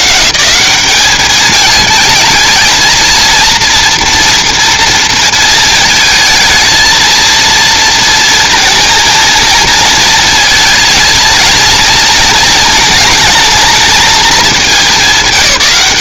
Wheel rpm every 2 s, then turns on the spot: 190, 220, 240, 220, 230, 220, 230, 210.
none